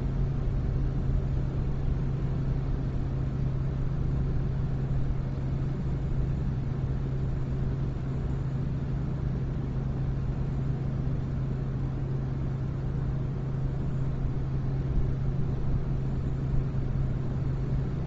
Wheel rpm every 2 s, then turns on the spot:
0, 0, 0, 0, 0, 0, 0, 0, 0.
none